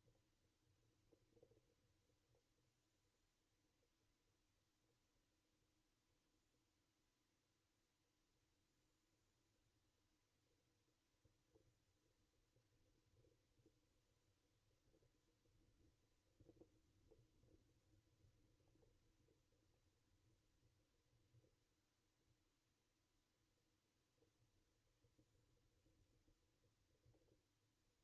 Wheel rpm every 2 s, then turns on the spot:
0, 0, 0, 0, 0, 0, 0, 0, 0, 0, 0, 0, 0, 0.
none